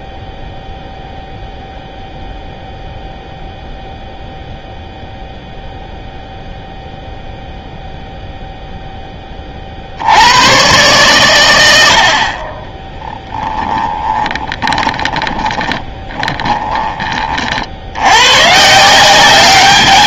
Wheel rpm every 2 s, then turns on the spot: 0, 0, 0, 0, 0, 110, 30, 20, 20, 150.
12-18